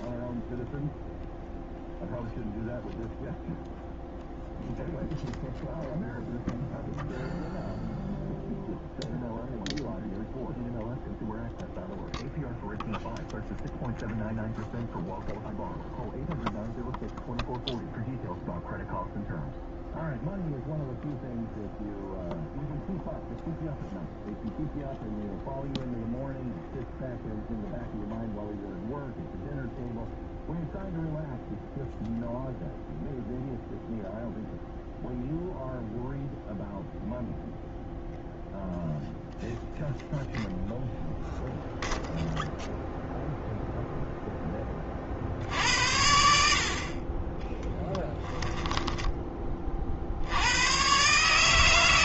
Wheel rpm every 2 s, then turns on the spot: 0, 0, 0, 0, 0, 0, 0, 0, 0, 0, 0, 0, 0, 0, 0, 0, 0, 0, 0, 0, 0, 0, 30, 50, 10, 110.
48-50